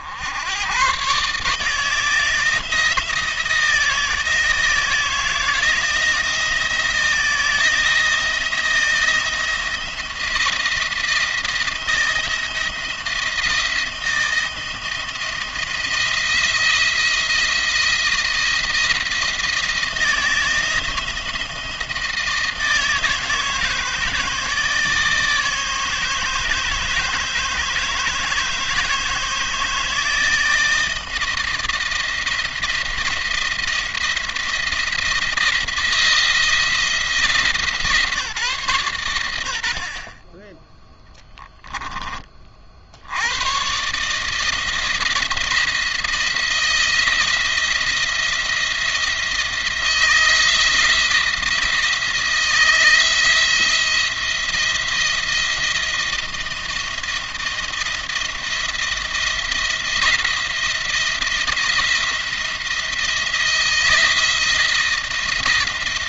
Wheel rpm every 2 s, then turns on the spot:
90, 160, 160, 160, 170, 170, 170, 170, 170, 170, 170, 160, 150, 150, 150, 160, 170, 170, 170, 140, 10, 50, 160, 170, 170, 170, 170, 170, 170, 170, 170, 170, 160.
none